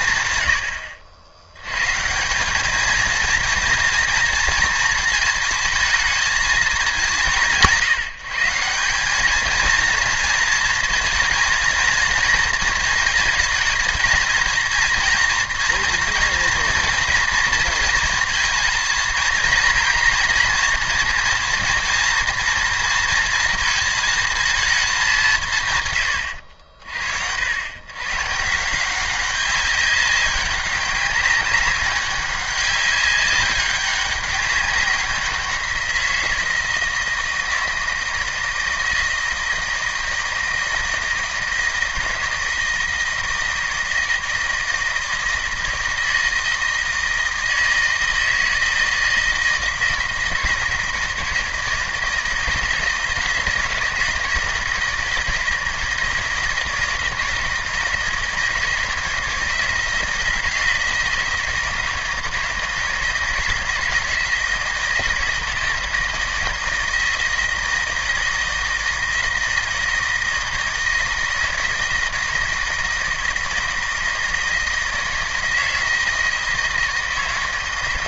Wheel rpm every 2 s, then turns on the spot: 100, 200, 230, 220, 180, 230, 220, 230, 230, 230, 230, 230, 210, 70, 170, 200, 200, 190, 160, 160, 160, 160, 160, 160, 160, 160, 160, 160, 160, 160, 170, 160, 160, 160, 160, 160, 160, 160, 160.
none